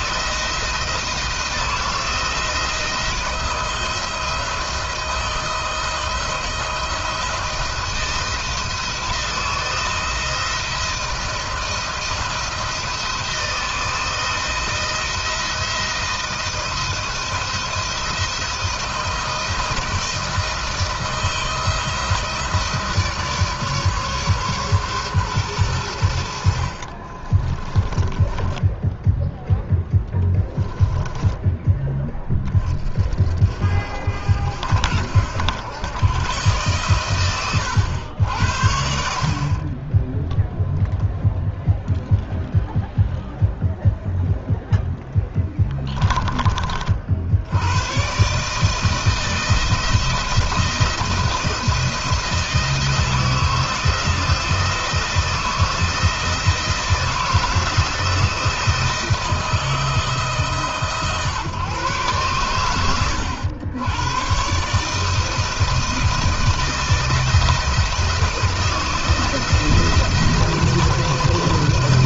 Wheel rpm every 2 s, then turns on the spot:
160, 160, 160, 170, 160, 160, 160, 160, 170, 160, 160, 160, 130, 40, 10, 20, 40, 70, 120, 60, 10, 0, 0, 50, 160, 170, 160, 170, 170, 170, 140, 100, 150, 160, 160, 170.
26-32